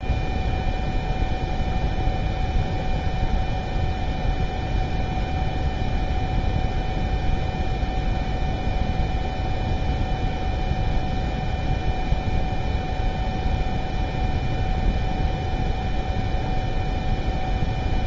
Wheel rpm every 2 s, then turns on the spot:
0, 0, 0, 0, 0, 0, 0, 0, 0.
none